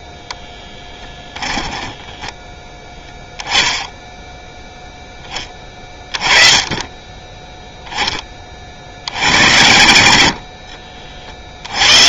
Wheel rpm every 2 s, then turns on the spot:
10, 10, 0, 10, 50, 40.
0-4